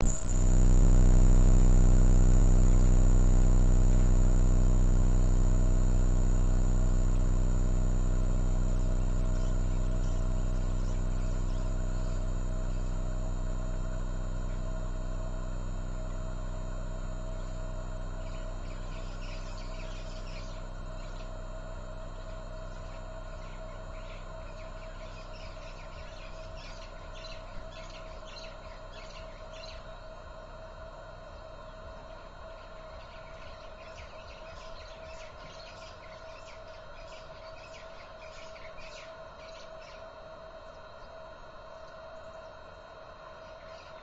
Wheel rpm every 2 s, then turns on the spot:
0, 0, 0, 0, 0, 0, 0, 0, 0, 0, 0, 0, 0, 0, 0, 0, 0, 0, 0, 0, 0, 0.
none